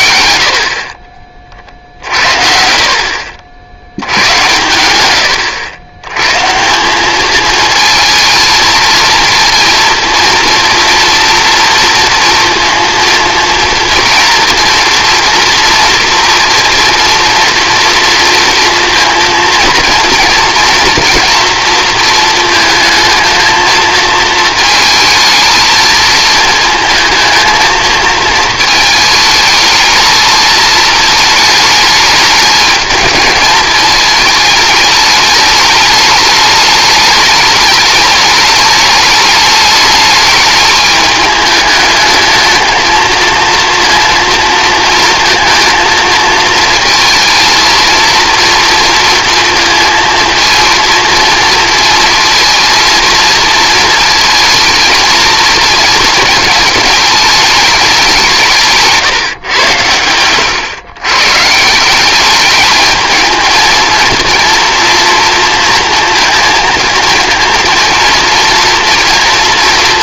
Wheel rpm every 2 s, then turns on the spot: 40, 60, 110, 210, 230, 230, 230, 230, 230, 230, 230, 220, 220, 230, 220, 220, 210, 210, 210, 210, 210, 230, 220, 220, 230, 230, 230, 220, 210, 130, 130, 220, 230, 230, 230.
none